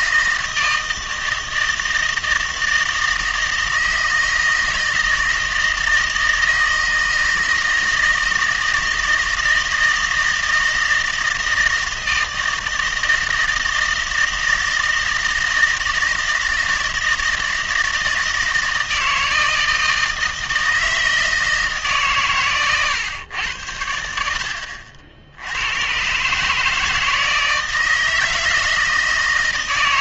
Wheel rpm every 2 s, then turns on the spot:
160, 160, 160, 160, 160, 160, 160, 160, 160, 160, 160, 120, 70, 150, 160.
24-26